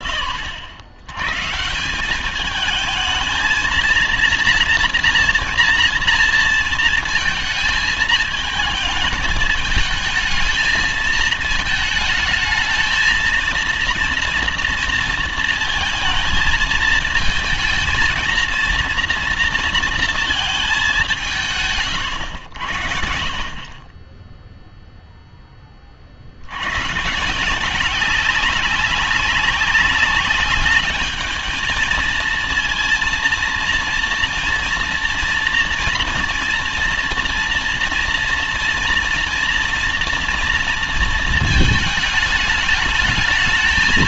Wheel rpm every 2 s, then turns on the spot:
60, 200, 230, 230, 220, 220, 220, 230, 220, 230, 220, 80, 0, 80, 190, 200, 230, 240, 230, 230, 230, 210.
none